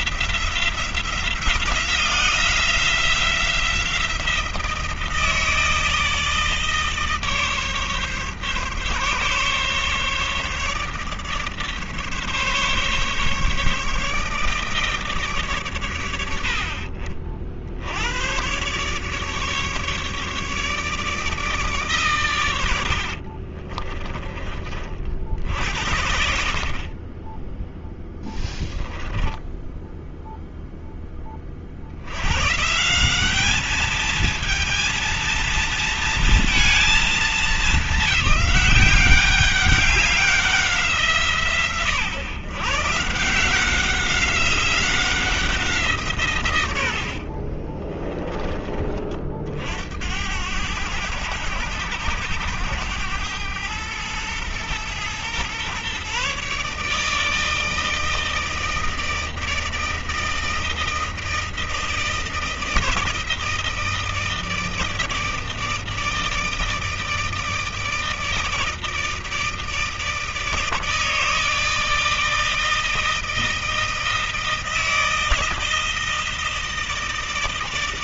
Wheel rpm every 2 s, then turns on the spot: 180, 180, 160, 150, 140, 150, 150, 150, 50, 130, 150, 80, 40, 30, 10, 10, 150, 230, 230, 200, 170, 130, 190, 100, 30, 110, 100, 120, 150, 160, 160, 160, 160, 160, 160, 160, 160, 160, 160.
22-24 28-30 46-48